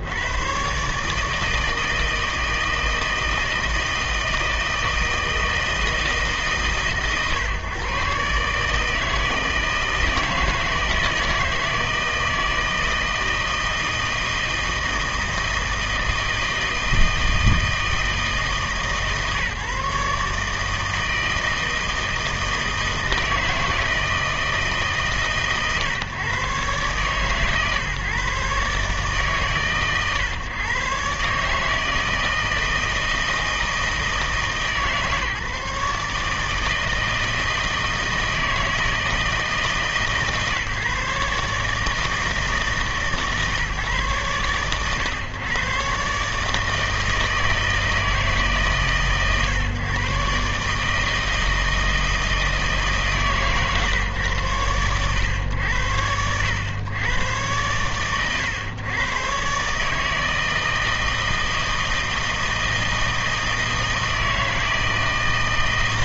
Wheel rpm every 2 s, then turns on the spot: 110, 160, 160, 140, 150, 160, 160, 160, 160, 160, 160, 160, 150, 140, 140, 130, 160, 150, 160, 160, 150, 160, 110, 160, 150, 140, 160, 110, 90, 100, 160, 160, 160.
none